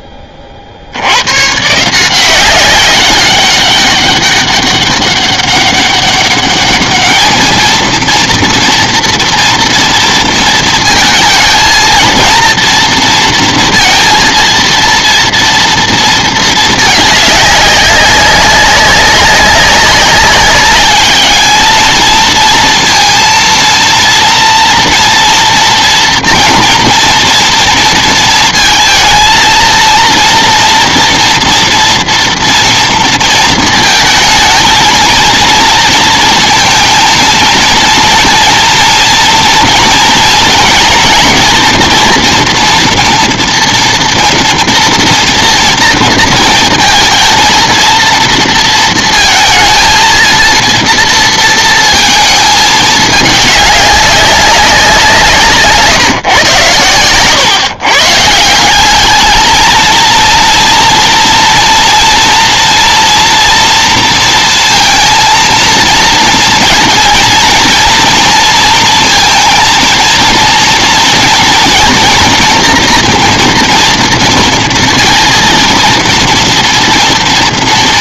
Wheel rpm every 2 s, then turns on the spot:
100, 190, 200, 210, 240, 230, 230, 230, 210, 200, 210, 230, 230, 230, 220, 230, 230, 220, 230, 230, 230, 230, 230, 230, 230, 230, 210, 180, 110, 210, 230, 240, 230, 230, 230, 230, 230, 230, 230.
none